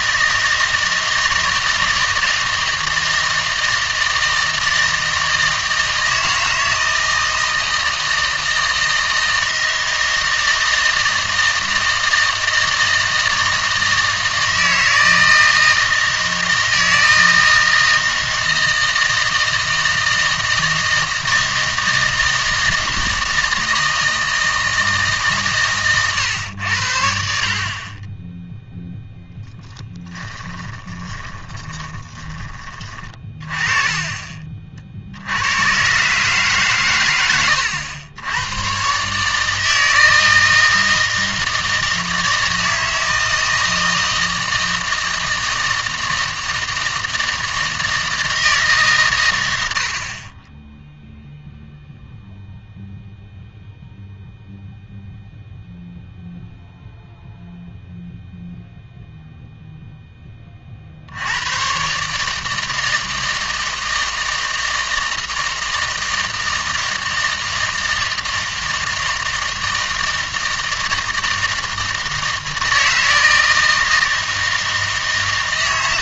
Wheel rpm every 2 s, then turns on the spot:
160, 160, 160, 160, 160, 160, 160, 160, 160, 160, 160, 160, 160, 90, 0, 10, 30, 50, 130, 120, 160, 160, 160, 160, 150, 10, 0, 0, 0, 0, 30, 160, 160, 160, 160, 160, 160, 160.
30-32